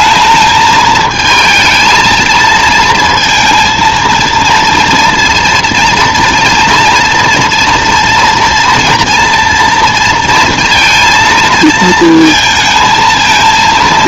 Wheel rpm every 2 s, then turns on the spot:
220, 230, 230, 230, 230, 230, 220.
none